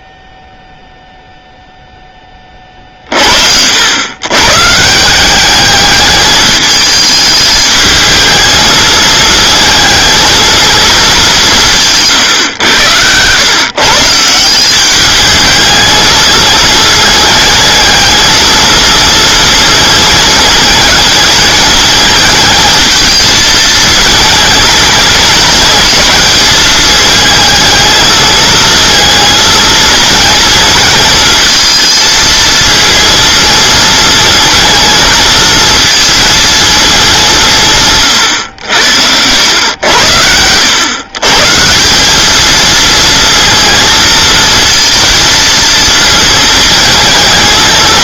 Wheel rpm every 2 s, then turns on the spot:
0, 40, 170, 220, 220, 210, 110, 210, 220, 230, 210, 220, 220, 210, 230, 220, 230, 230, 210, 80, 120, 230, 230, 220.
none